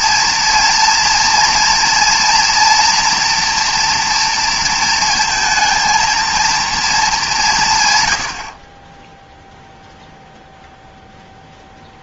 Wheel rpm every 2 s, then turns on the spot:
230, 230, 230, 220, 20, 0.
none